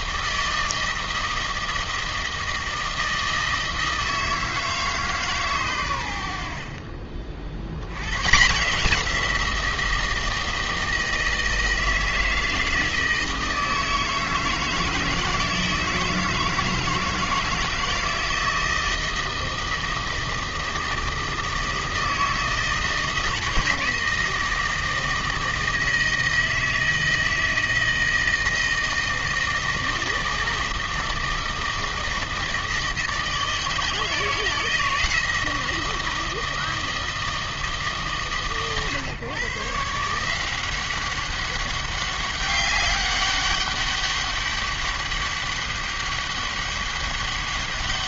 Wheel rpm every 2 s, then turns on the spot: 160, 160, 160, 60, 160, 160, 160, 160, 160, 160, 160, 160, 160, 160, 160, 160, 160, 160, 160, 130, 180, 200, 200, 200.
none